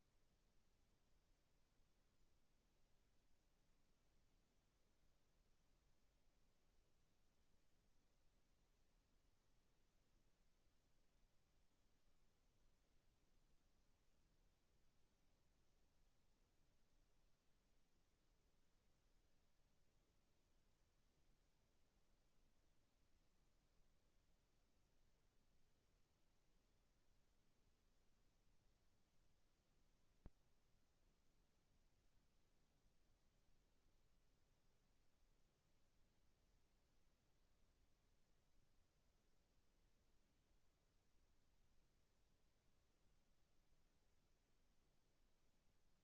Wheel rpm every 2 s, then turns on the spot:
0, 0, 0, 0, 0, 0, 0, 0, 0, 0, 0, 0, 0, 0, 0, 0, 0, 0, 0, 0, 0, 0, 0.
none